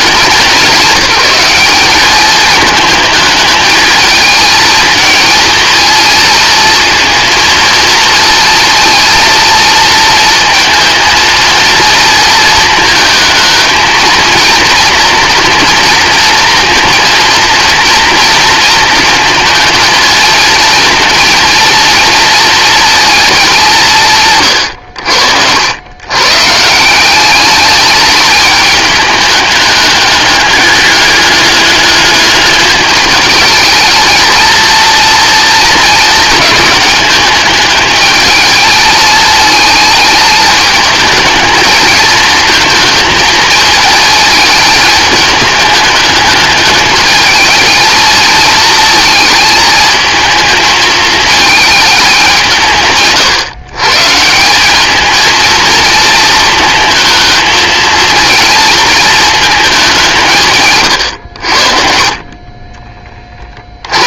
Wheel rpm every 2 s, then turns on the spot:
190, 220, 220, 230, 230, 230, 220, 230, 230, 220, 230, 220, 80, 170, 210, 200, 210, 230, 210, 220, 220, 220, 220, 220, 230, 220, 150, 210, 230, 220, 110, 20.
60-62